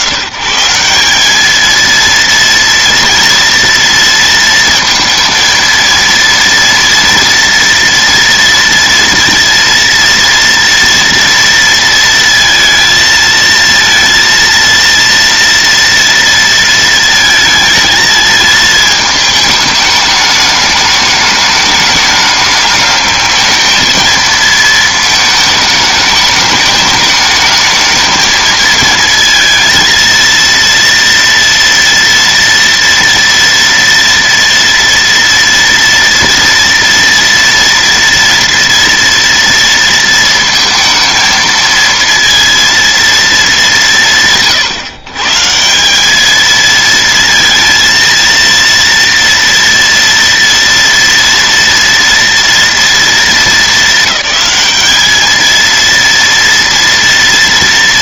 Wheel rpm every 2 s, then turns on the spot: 120, 230, 230, 230, 230, 230, 230, 230, 230, 220, 210, 210, 220, 210, 220, 230, 230, 230, 230, 230, 220, 230, 140, 220, 230, 230, 230, 210, 230.
none